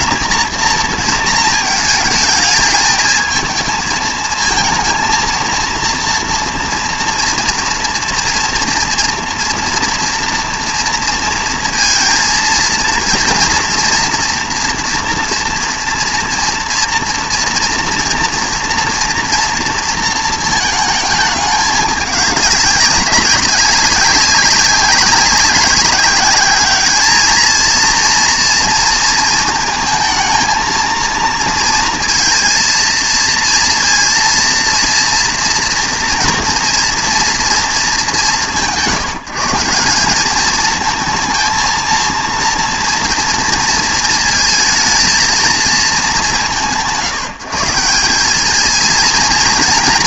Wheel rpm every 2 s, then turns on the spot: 230, 220, 230, 230, 240, 230, 230, 230, 230, 240, 220, 200, 200, 210, 230, 230, 230, 230, 230, 150, 220, 230, 220, 140, 220.
none